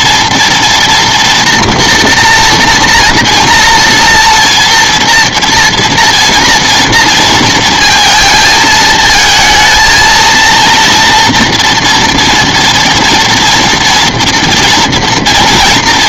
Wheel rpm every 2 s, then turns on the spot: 240, 240, 230, 230, 230, 230, 230, 240.
none